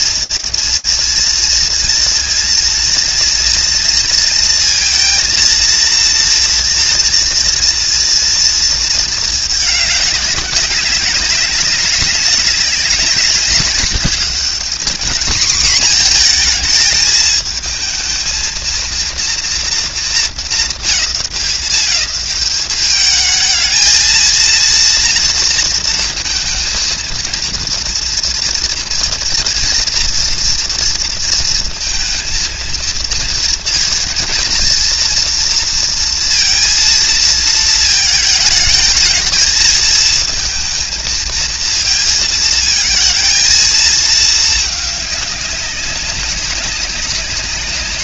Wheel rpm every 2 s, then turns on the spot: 230, 230, 230, 230, 230, 200, 190, 210, 230, 230, 200, 200, 230, 230, 230, 230, 230, 230, 230, 220, 230, 220, 220, 200.
none